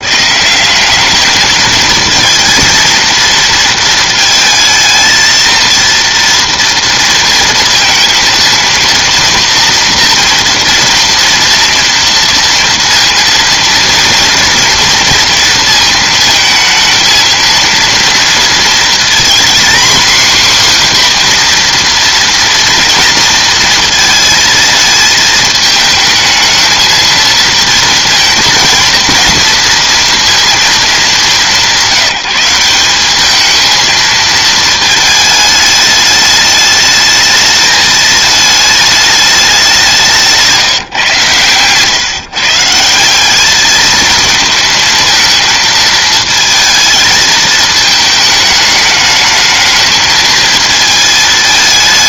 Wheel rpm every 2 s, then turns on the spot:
180, 230, 220, 230, 230, 230, 230, 230, 220, 230, 260, 230, 220, 220, 230, 220, 180, 220, 210, 220, 150, 170, 220, 220, 220, 220.
none